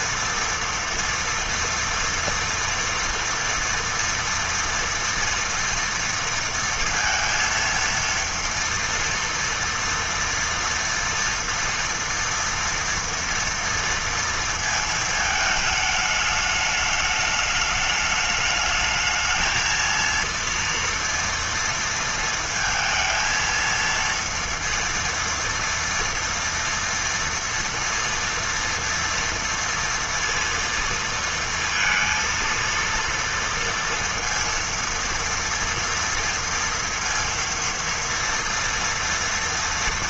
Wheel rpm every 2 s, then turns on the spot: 230, 230, 230, 230, 230, 240, 240, 230, 210, 210, 230, 230, 230, 230, 230, 230, 230, 230, 230, 230.
none